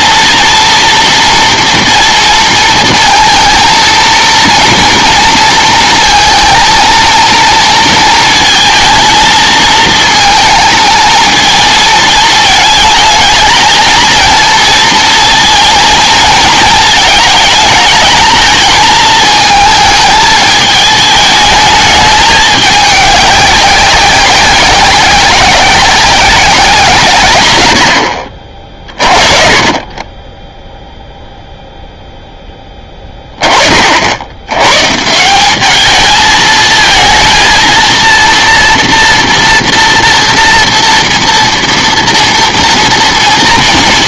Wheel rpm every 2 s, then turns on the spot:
230, 230, 240, 220, 230, 220, 220, 230, 230, 220, 220, 210, 200, 180, 40, 0, 10, 130, 220, 230, 230, 230.
none